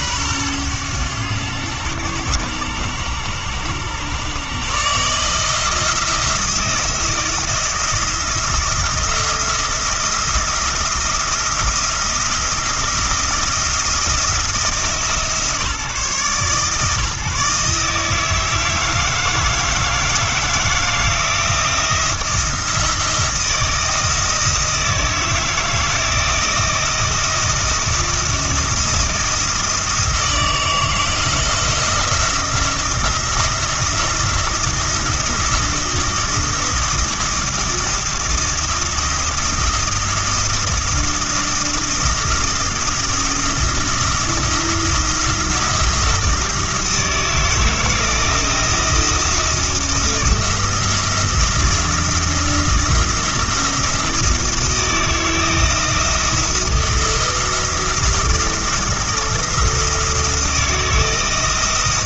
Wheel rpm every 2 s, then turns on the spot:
110, 100, 140, 170, 170, 170, 170, 160, 150, 160, 170, 170, 160, 170, 170, 160, 170, 170, 170, 170, 170, 170, 160, 160, 170, 170, 170, 160, 170, 170, 160.
none